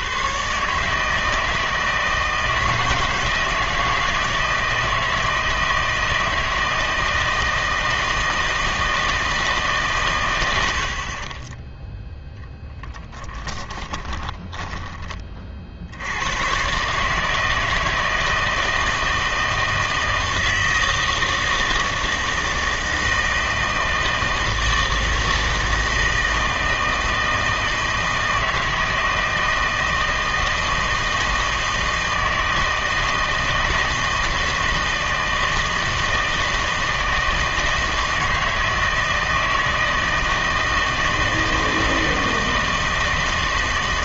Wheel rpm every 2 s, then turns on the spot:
140, 160, 160, 160, 160, 90, 0, 10, 130, 160, 160, 160, 160, 160, 160, 160, 160, 160, 160, 160, 160, 160.
14-16